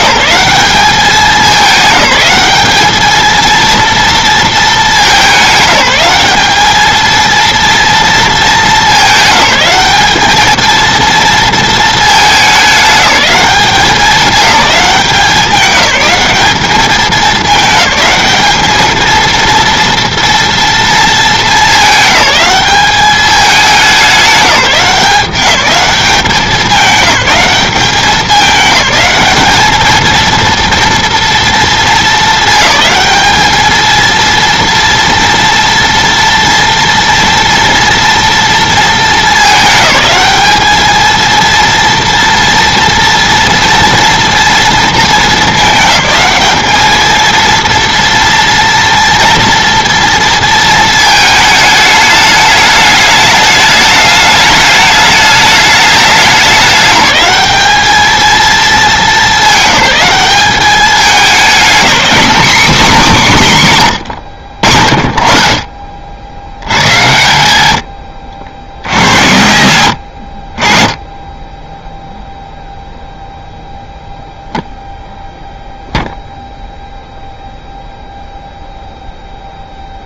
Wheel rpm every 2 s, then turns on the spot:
200, 210, 220, 210, 220, 220, 210, 200, 200, 220, 230, 200, 190, 190, 200, 230, 220, 230, 230, 220, 210, 230, 230, 210, 230, 230, 210, 210, 200, 220, 200, 250, 60, 90, 90, 40, 0, 0, 0, 0.
none